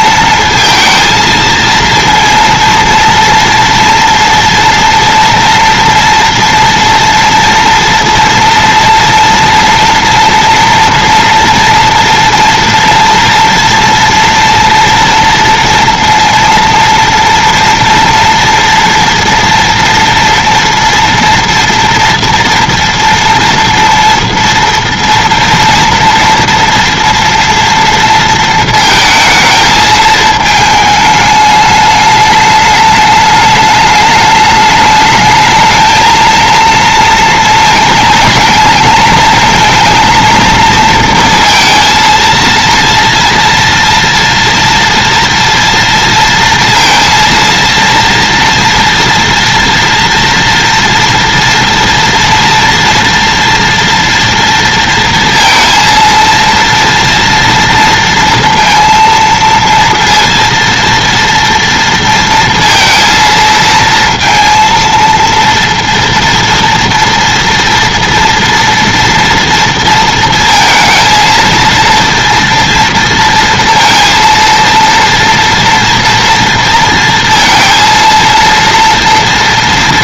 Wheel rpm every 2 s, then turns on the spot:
230, 230, 230, 230, 230, 240, 230, 230, 230, 230, 230, 230, 230, 230, 220, 220, 210, 210, 230, 220, 230, 230, 230, 230, 230, 230, 230, 230, 230, 230, 230, 230, 230, 230, 230, 230, 230, 230, 230, 230.
none